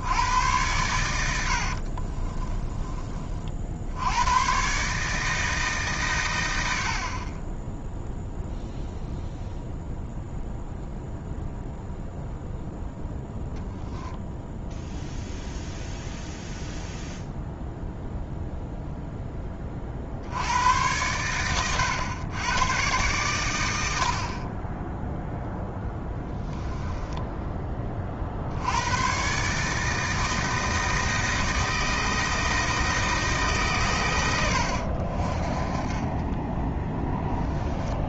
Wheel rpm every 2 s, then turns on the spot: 80, 30, 110, 120, 0, 0, 0, 0, 0, 0, 100, 110, 10, 10, 100, 160, 160, 60, 10.
2-4 26-28 36-38